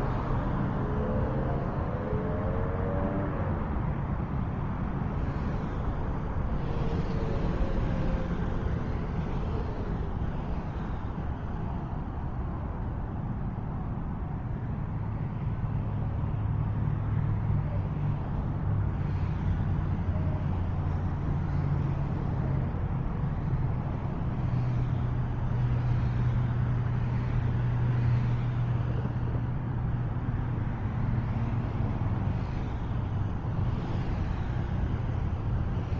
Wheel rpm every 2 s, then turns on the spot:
0, 0, 0, 0, 0, 0, 0, 0, 0, 0, 0, 0, 0, 0, 0, 0, 0, 0.
none